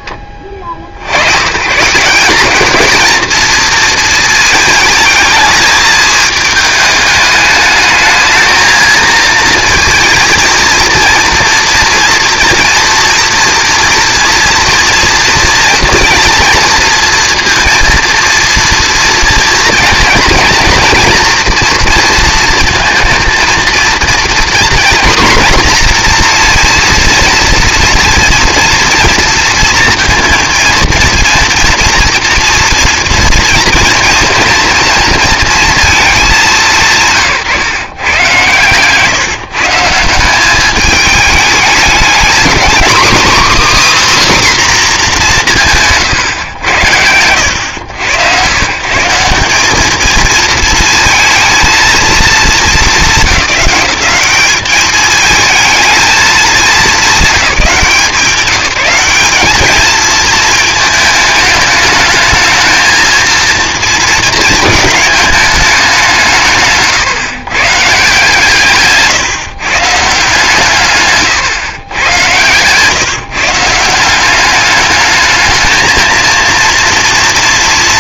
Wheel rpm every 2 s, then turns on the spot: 50, 220, 220, 210, 220, 230, 230, 230, 230, 230, 240, 230, 250, 240, 230, 230, 230, 230, 160, 130, 200, 240, 270, 110, 130, 230, 220, 200, 210, 180, 220, 220, 220, 140, 150, 150, 130, 210, 230.
none